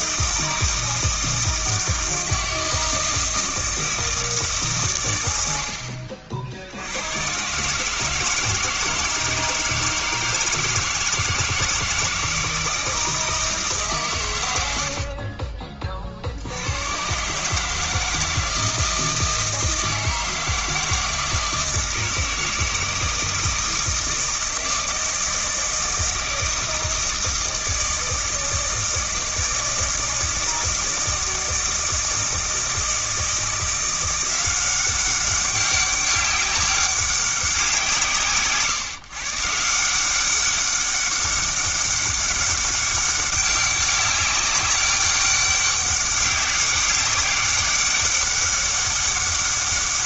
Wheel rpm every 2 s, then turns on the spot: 160, 160, 130, 90, 160, 160, 160, 70, 110, 160, 160, 160, 160, 160, 160, 160, 160, 190, 190, 140, 200, 200, 200, 200, 200.
14-16